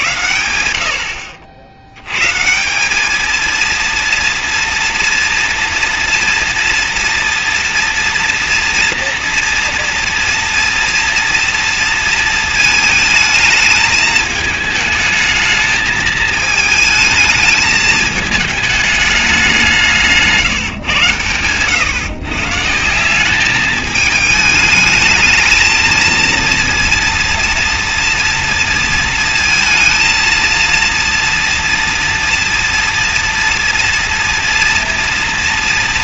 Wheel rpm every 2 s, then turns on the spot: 70, 170, 230, 230, 240, 230, 220, 220, 220, 220, 160, 150, 220, 230, 230, 230, 230, 230.
none